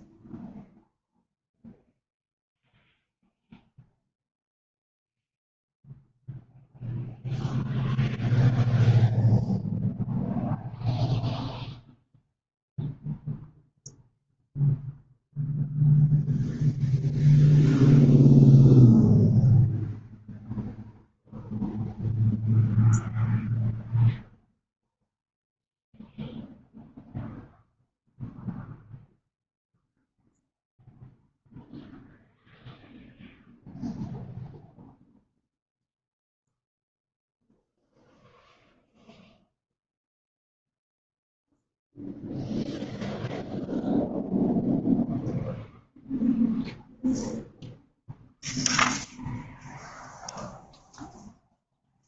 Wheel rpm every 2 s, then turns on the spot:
0, 0, 0, 0, 0, 0, 0, 0, 0, 0, 0, 0, 0, 0, 0, 0, 0, 0, 0, 0, 0, 0, 0, 0, 0, 0.
none